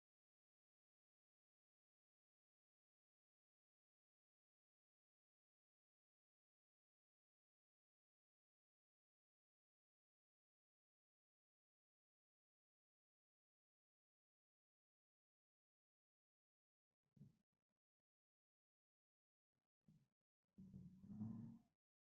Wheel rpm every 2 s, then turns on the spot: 0, 0, 0, 0, 0, 0, 0, 0, 0, 0, 0.
none